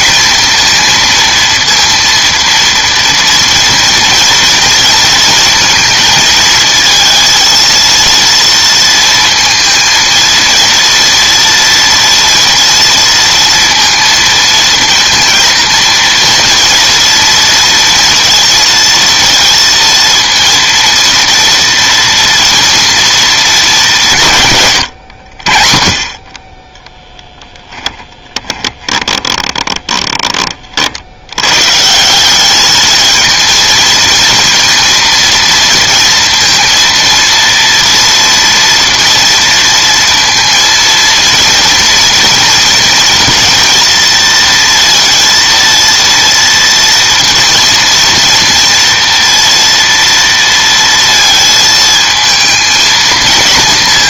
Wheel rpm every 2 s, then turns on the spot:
230, 230, 230, 230, 230, 230, 230, 230, 240, 230, 230, 230, 100, 10, 20, 50, 210, 230, 230, 230, 230, 230, 230, 240, 230, 230, 230.
28-30